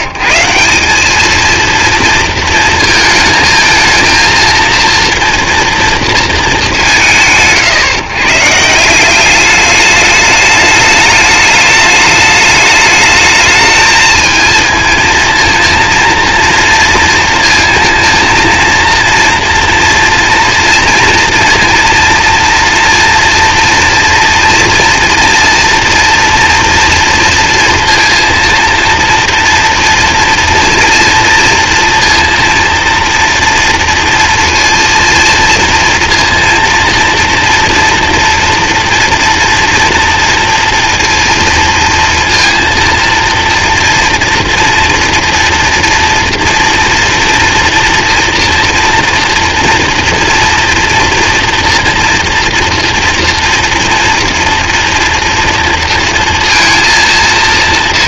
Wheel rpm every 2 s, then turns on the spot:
130, 230, 230, 210, 150, 210, 210, 230, 230, 230, 240, 230, 230, 230, 230, 230, 230, 230, 230, 230, 230, 230, 230, 240, 230, 230, 230, 230, 230.
none